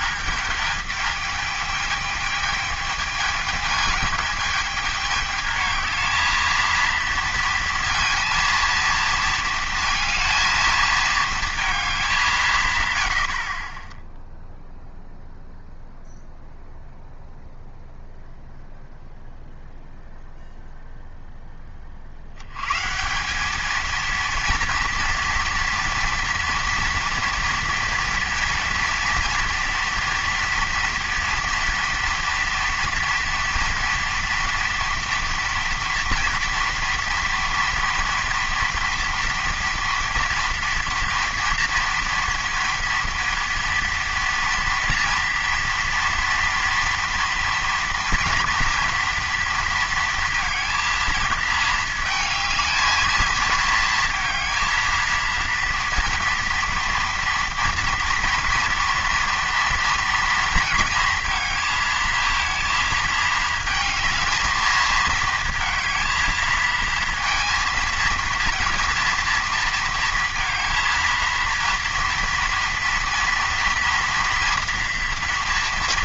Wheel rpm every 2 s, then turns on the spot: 210, 220, 220, 230, 230, 220, 140, 0, 0, 0, 0, 120, 230, 230, 230, 230, 230, 240, 230, 230, 230, 230, 230, 230, 230, 230, 220, 230, 230, 230, 230, 230, 220, 230, 230, 230, 230, 240.
none